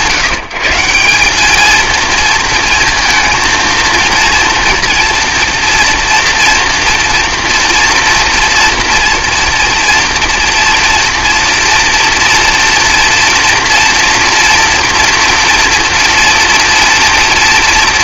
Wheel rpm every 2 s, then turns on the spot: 160, 230, 230, 230, 230, 230, 240, 240, 230.
none